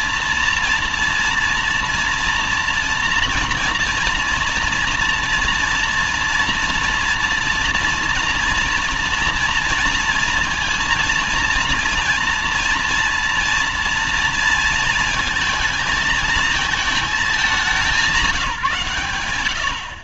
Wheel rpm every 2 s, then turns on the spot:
230, 240, 240, 230, 230, 230, 230, 230, 220, 160.
none